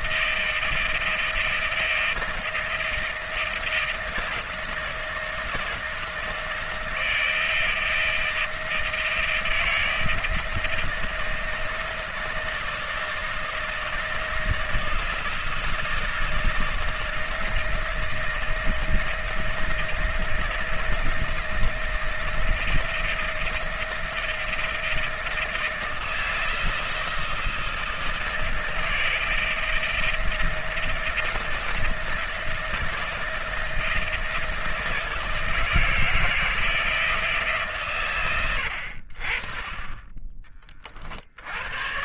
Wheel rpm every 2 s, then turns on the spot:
170, 170, 160, 160, 170, 160, 170, 160, 160, 160, 170, 160, 160, 170, 160, 170, 170, 160, 160, 60, 60.
none